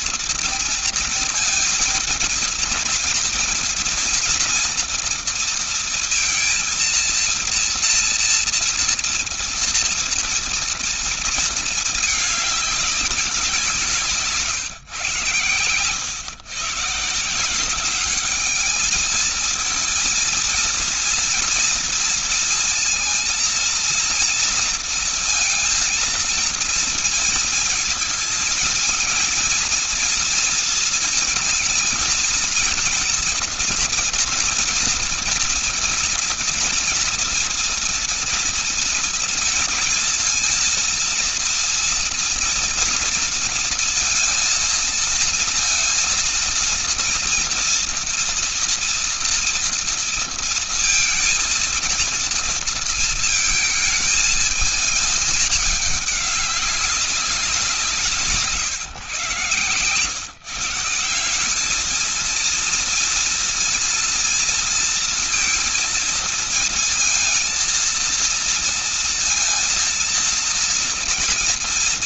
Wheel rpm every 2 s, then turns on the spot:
230, 230, 230, 230, 230, 230, 200, 150, 130, 210, 230, 230, 230, 230, 230, 230, 230, 240, 230, 230, 230, 230, 230, 230, 230, 230, 230, 220, 200, 150, 140, 220, 230, 230, 230, 230.
none